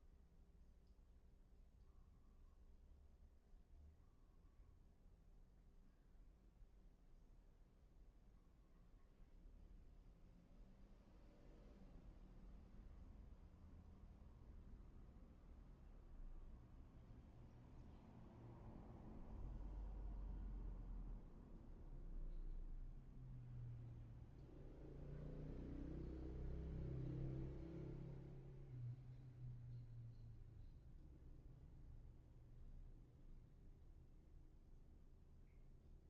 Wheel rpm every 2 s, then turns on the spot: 0, 0, 0, 0, 0, 0, 0, 0, 0, 0, 0, 0, 0, 0, 0, 0, 0, 0.
none